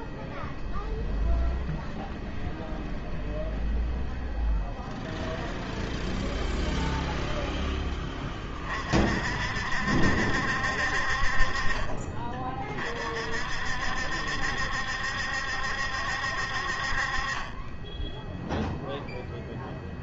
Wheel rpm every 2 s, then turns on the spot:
0, 0, 0, 0, 40, 50, 50, 70, 50, 0.
none